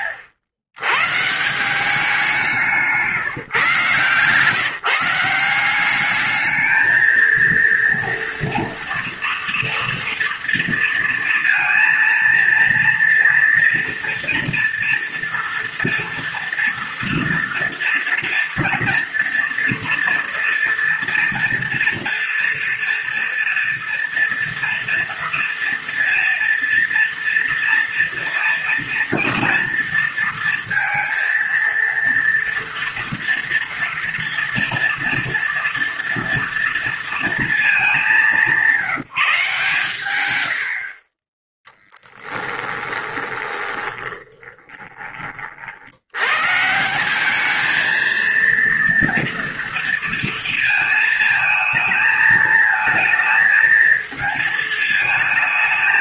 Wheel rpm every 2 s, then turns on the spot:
100, 170, 160, 220, 230, 230, 230, 240, 230, 230, 230, 230, 230, 230, 230, 230, 230, 230, 230, 190, 70, 20, 20, 150, 230, 230, 220, 220.
42-46